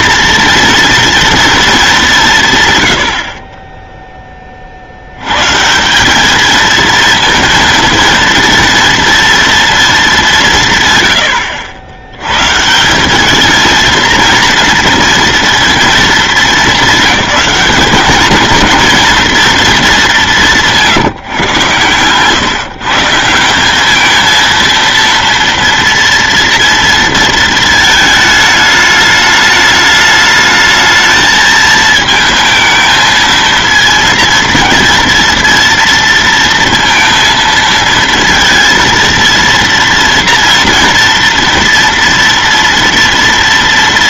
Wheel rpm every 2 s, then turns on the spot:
230, 140, 50, 220, 230, 140, 160, 230, 210, 230, 170, 140, 230, 230, 210, 220, 220, 230, 230, 230, 230, 230.
none